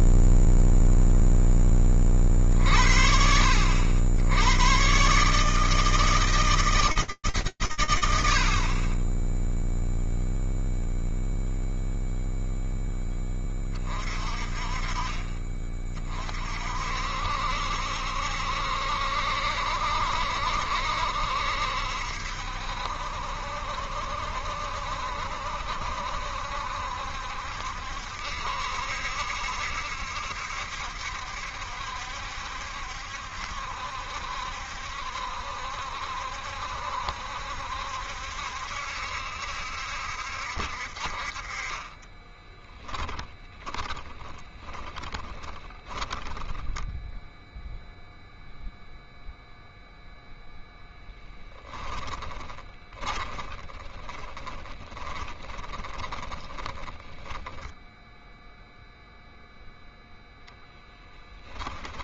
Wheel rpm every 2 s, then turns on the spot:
0, 20, 80, 150, 70, 0, 0, 30, 50, 70, 70, 70, 70, 70, 70, 70, 70, 70, 70, 70, 60, 10, 20, 10, 0, 0, 20, 20, 10, 0, 0.
42-48 52-58